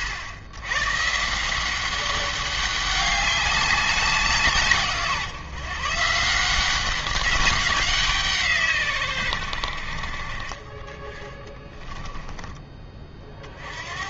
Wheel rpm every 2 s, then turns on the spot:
120, 200, 150, 180, 140, 30, 20.
none